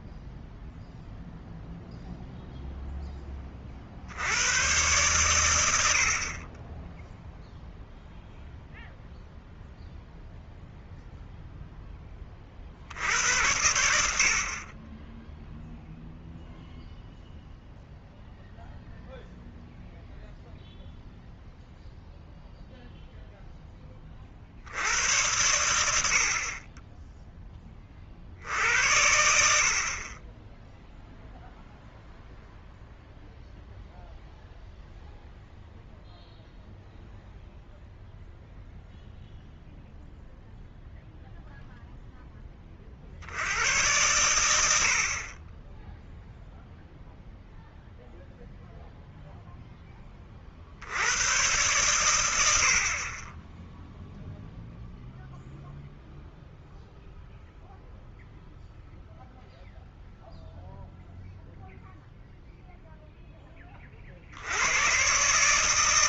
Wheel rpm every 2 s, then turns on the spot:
0, 0, 110, 20, 0, 0, 50, 40, 0, 0, 0, 0, 70, 40, 80, 10, 0, 0, 0, 0, 0, 30, 80, 0, 0, 50, 70, 0, 0, 0, 0, 0, 90.
none